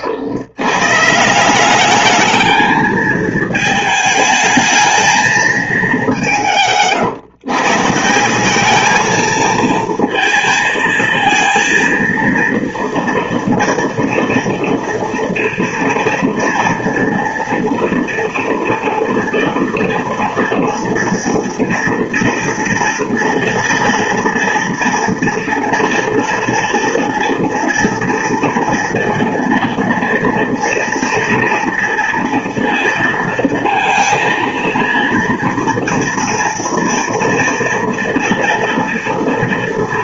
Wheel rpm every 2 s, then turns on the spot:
150, 220, 220, 140, 220, 230, 230, 230, 230, 230, 230, 230, 230, 230, 230, 230, 230, 230, 230, 230.
none